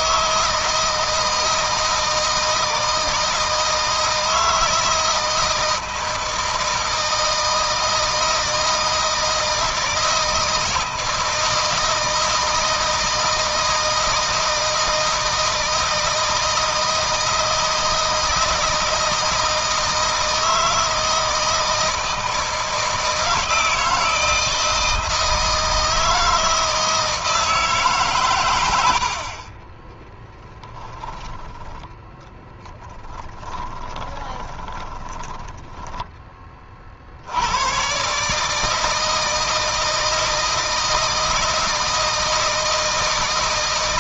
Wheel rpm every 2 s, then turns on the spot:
160, 160, 160, 160, 160, 160, 160, 160, 160, 160, 160, 160, 160, 160, 90, 20, 10, 10, 50, 160, 160, 160.
32-36